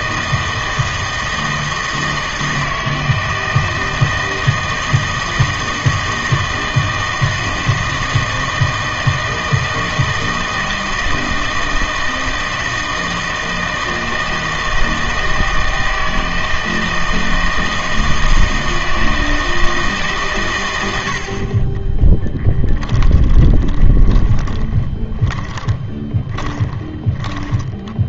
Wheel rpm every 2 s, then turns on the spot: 160, 160, 160, 160, 160, 160, 160, 160, 160, 160, 110, 10, 20, 20.
22-28